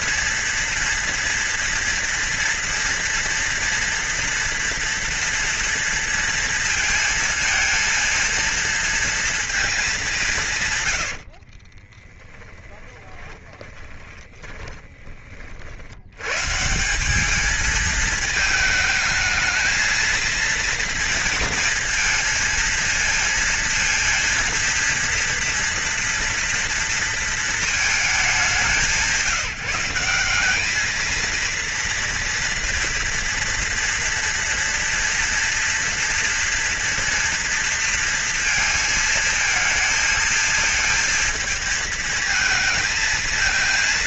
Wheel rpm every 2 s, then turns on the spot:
230, 240, 230, 230, 230, 140, 10, 30, 160, 220, 230, 230, 230, 230, 200, 210, 230, 230, 230, 230, 230, 220.
none